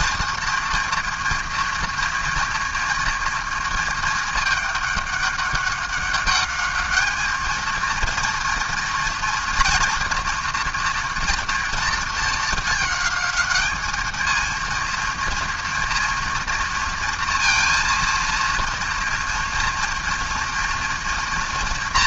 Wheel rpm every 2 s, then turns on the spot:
230, 230, 210, 210, 230, 240, 210, 230, 230, 230, 230.
none